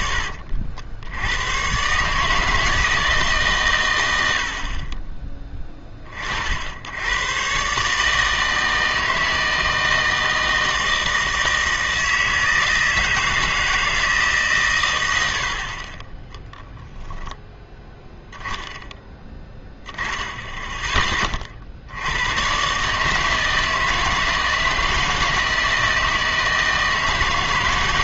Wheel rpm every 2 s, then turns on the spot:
70, 160, 60, 60, 160, 160, 160, 130, 10, 10, 10, 120, 160, 160.
none